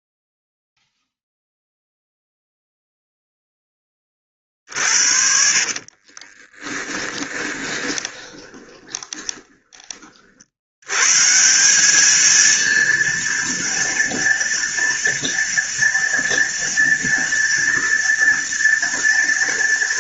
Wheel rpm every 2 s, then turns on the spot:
0, 0, 50, 20, 20, 80, 230, 230, 230, 230.
4-10